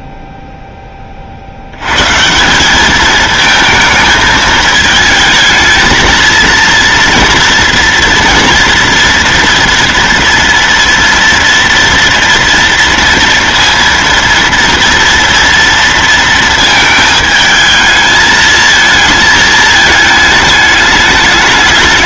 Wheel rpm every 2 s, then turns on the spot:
20, 210, 220, 230, 230, 230, 230, 230, 220, 220, 210.
none